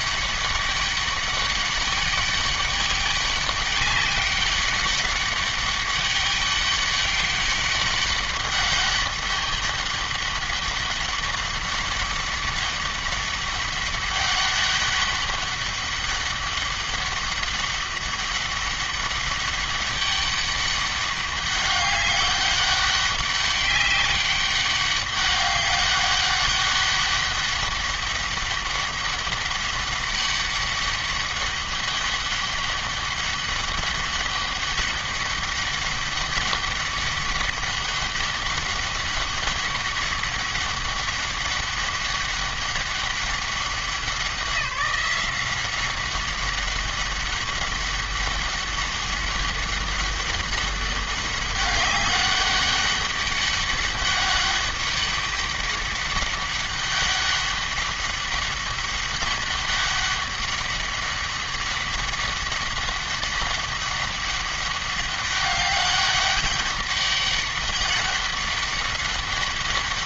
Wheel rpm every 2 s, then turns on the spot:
200, 200, 200, 200, 200, 200, 200, 200, 200, 200, 200, 200, 190, 200, 200, 200, 200, 200, 200, 200, 200, 200, 180, 200, 200, 200, 200, 200, 200, 200, 200, 200, 200, 200, 200.
none